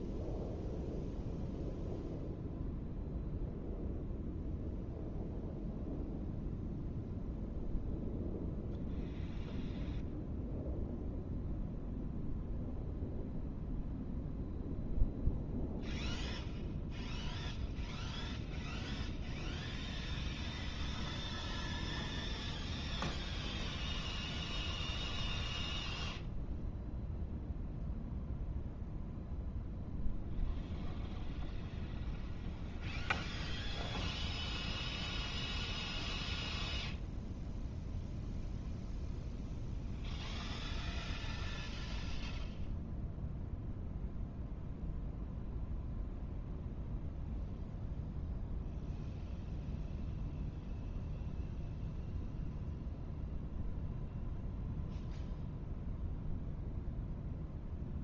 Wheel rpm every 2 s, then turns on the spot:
0, 0, 0, 0, 0, 0, 0, 0, 0, 0, 0, 0, 0, 0, 0, 0, 0, 0, 0, 0, 0, 0, 0, 0, 0, 0, 0, 0, 0.
none